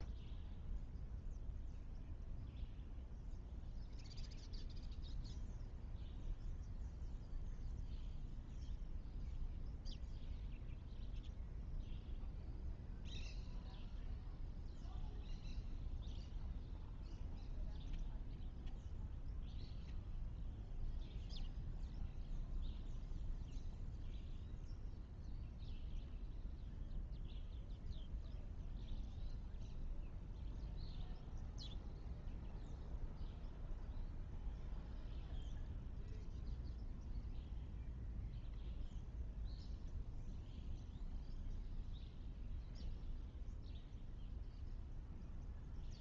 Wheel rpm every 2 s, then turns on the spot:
0, 0, 0, 0, 0, 0, 0, 0, 0, 0, 0, 0, 0, 0, 0, 0, 0, 0, 0, 0, 0, 0, 0.
none